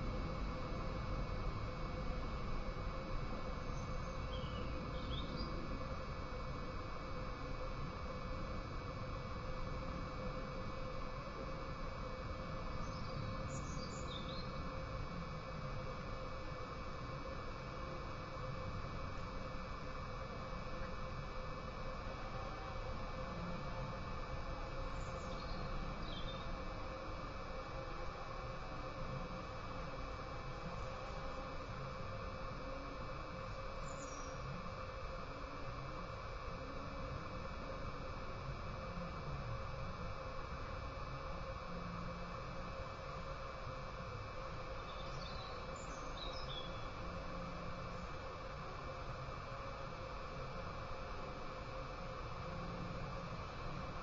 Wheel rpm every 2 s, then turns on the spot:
0, 0, 0, 0, 0, 0, 0, 0, 0, 0, 0, 0, 0, 0, 0, 0, 0, 0, 0, 0, 0, 0, 0, 0, 0, 0, 0.
none